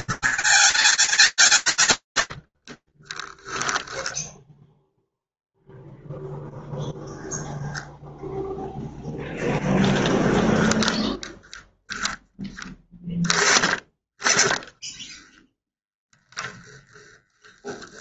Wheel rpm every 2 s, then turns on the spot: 100, 0, 0, 0, 10, 10, 10, 0, 10.
0-2